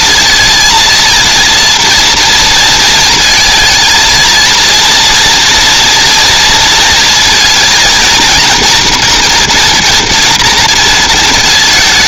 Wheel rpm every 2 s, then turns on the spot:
230, 230, 230, 230, 240, 230.
none